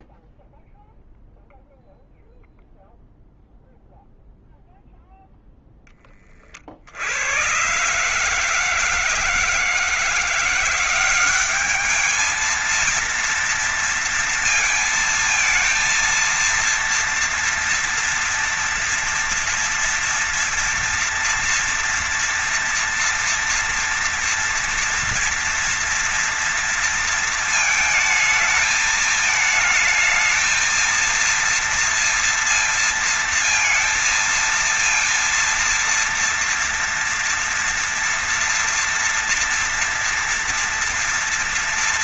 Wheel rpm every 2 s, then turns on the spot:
0, 0, 0, 70, 160, 180, 230, 230, 230, 230, 230, 230, 230, 230, 220, 230, 230, 230, 240, 230, 240.
none